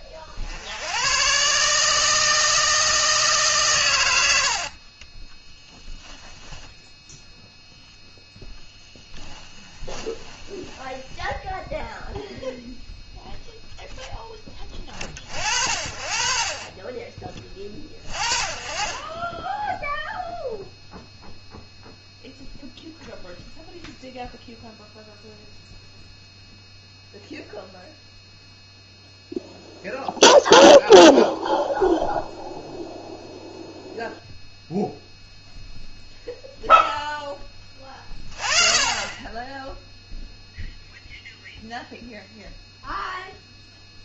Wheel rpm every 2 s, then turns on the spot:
70, 160, 50, 10, 10, 20, 0, 10, 30, 20, 0, 0, 0, 0, 0, 0, 0, 0, 0, 30, 0, 0.
4-6 8-12